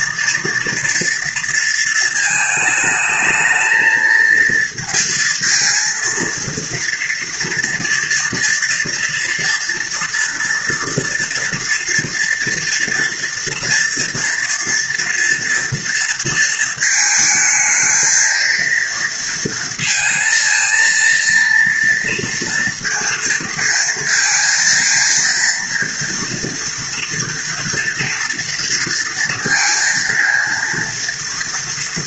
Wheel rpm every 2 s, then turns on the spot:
230, 220, 220, 230, 240, 230, 230, 230, 220, 230, 230, 230, 230, 230, 230, 230.
none